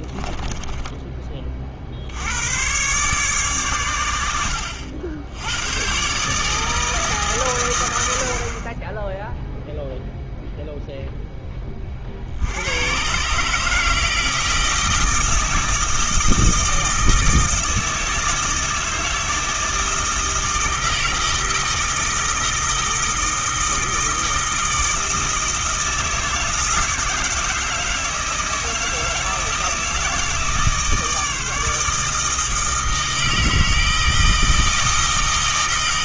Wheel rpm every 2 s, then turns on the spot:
20, 130, 80, 160, 30, 0, 100, 160, 160, 160, 160, 160, 160, 160, 160, 160, 160, 160.
none